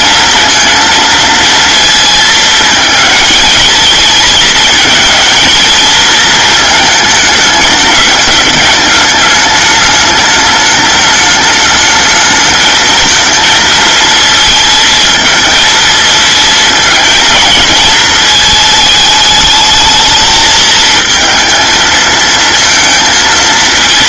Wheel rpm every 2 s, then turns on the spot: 230, 220, 220, 220, 210, 210, 220, 230, 230, 220, 220, 230.
none